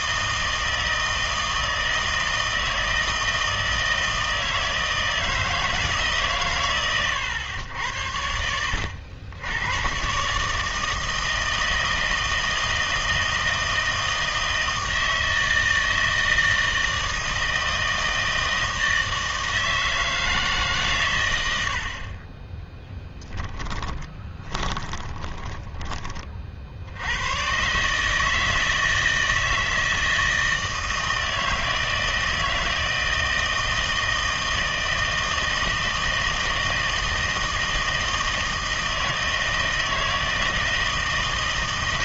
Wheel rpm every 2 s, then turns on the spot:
160, 160, 160, 120, 90, 160, 160, 160, 160, 160, 140, 10, 20, 70, 160, 160, 160, 160, 160, 160, 160.
24-26